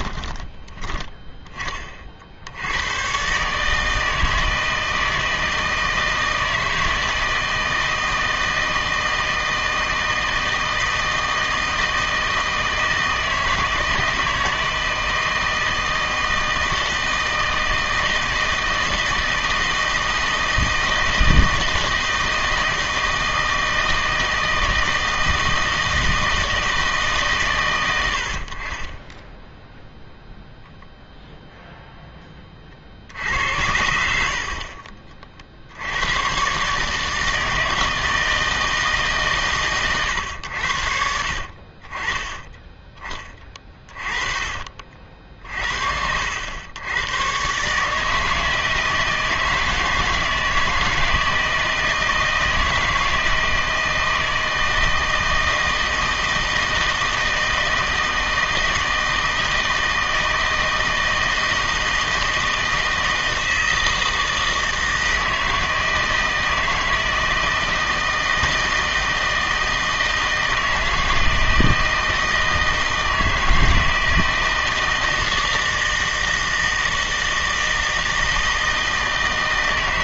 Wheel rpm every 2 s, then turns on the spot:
10, 90, 160, 160, 160, 160, 160, 160, 160, 160, 160, 160, 160, 150, 40, 0, 50, 40, 140, 160, 80, 20, 40, 90, 160, 160, 160, 160, 160, 160, 160, 160, 160, 160, 160, 160, 160, 160, 160, 160.
none